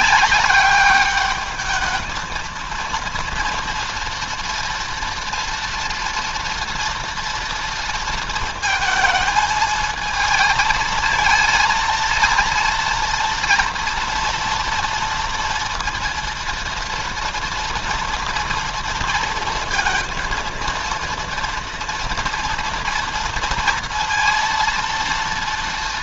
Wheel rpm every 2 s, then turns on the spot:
200, 230, 240, 230, 230, 220, 230, 230, 230, 230, 230, 230, 230.
none